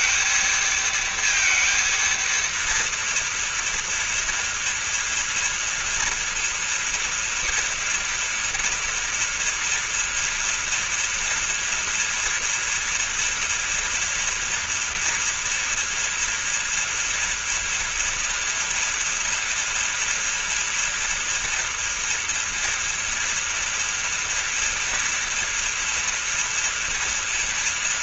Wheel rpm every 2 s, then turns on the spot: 230, 230, 230, 230, 230, 230, 230, 230, 230, 230, 230, 240, 230, 230.
none